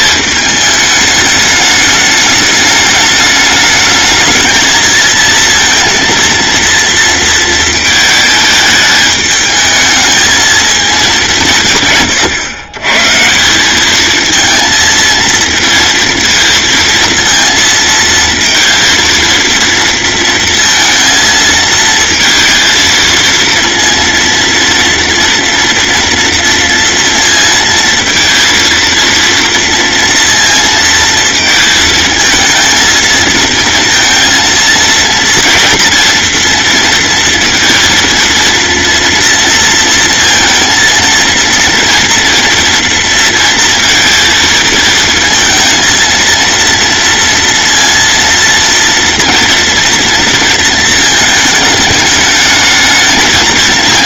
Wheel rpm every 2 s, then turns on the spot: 210, 210, 220, 230, 210, 220, 120, 230, 230, 230, 230, 230, 230, 230, 230, 230, 230, 230, 230, 230, 230, 230, 220, 230, 230, 220, 220.
none